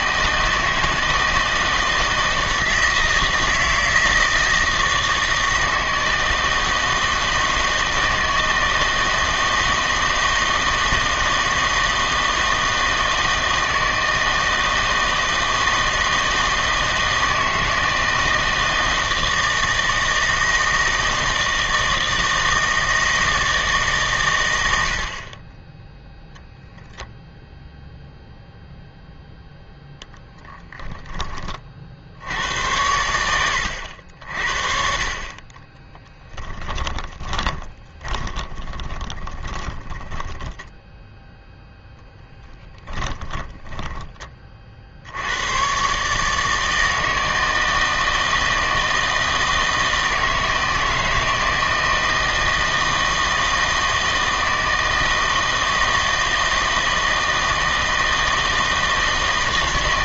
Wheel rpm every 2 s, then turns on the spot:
160, 160, 160, 160, 160, 160, 160, 160, 160, 160, 160, 160, 90, 0, 0, 10, 100, 50, 20, 20, 10, 10, 50, 160, 160, 160, 160, 160, 160, 160.
30-32 36-44